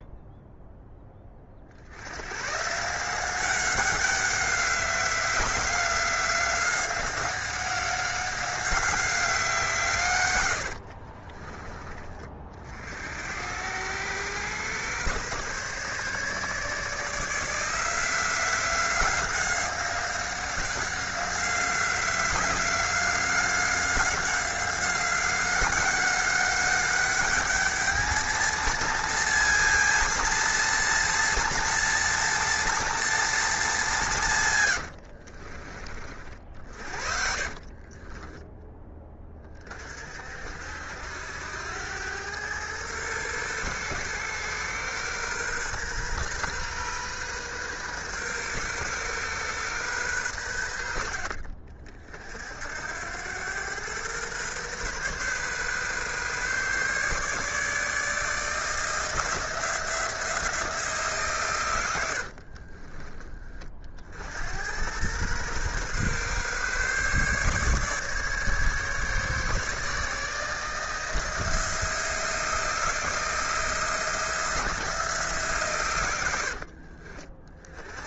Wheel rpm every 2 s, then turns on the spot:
10, 160, 190, 190, 190, 60, 70, 120, 150, 180, 190, 190, 190, 200, 230, 230, 230, 100, 40, 10, 70, 110, 120, 130, 130, 90, 80, 130, 140, 160, 160, 30, 90, 140, 150, 160, 170, 170, 60.
10-12 34-36 62-64 76-78